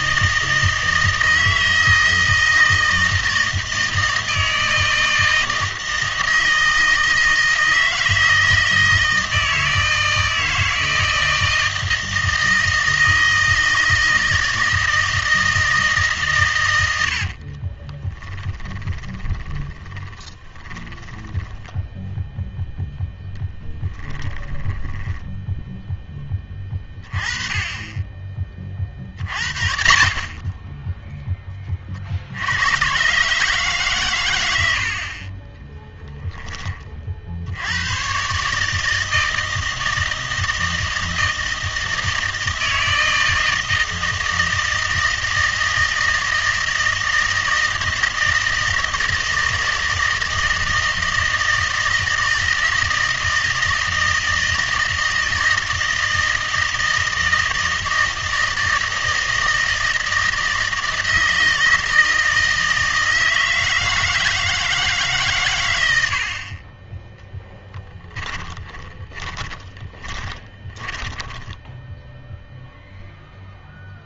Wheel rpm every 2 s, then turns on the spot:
160, 160, 160, 160, 160, 160, 160, 160, 100, 20, 10, 0, 10, 20, 30, 10, 100, 80, 30, 150, 160, 160, 160, 160, 160, 160, 160, 160, 160, 160, 160, 160, 160, 30, 20, 20, 0.
18-22 24-26 68-72